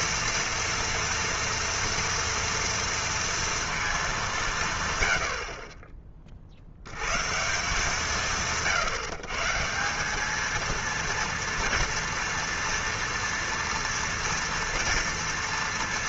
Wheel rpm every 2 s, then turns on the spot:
230, 230, 170, 70, 160, 230, 230, 230.
none